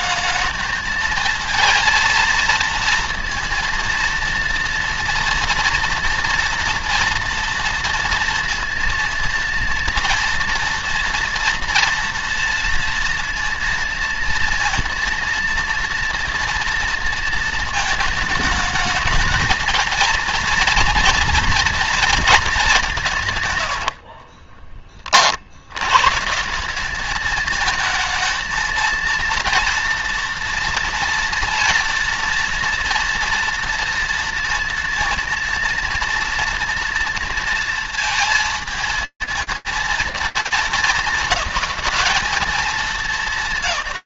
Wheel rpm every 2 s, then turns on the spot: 210, 230, 230, 240, 230, 230, 240, 230, 230, 220, 230, 210, 60, 150, 220, 230, 230, 230, 230, 230, 220, 220.
24-26